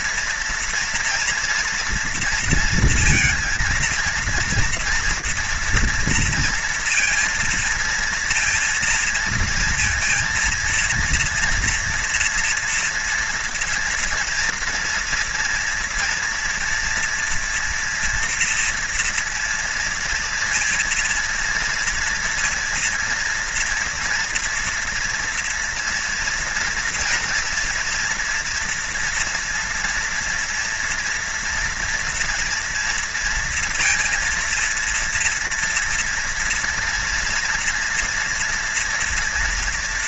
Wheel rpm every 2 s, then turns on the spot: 230, 230, 230, 230, 230, 230, 230, 230, 240, 230, 230, 230, 230, 230, 230, 230, 230, 230, 240, 230.
none